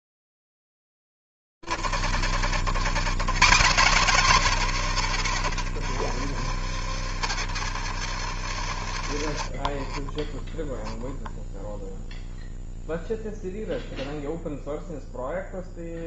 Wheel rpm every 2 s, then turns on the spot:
30, 30, 150, 90, 80, 30, 0, 0.
none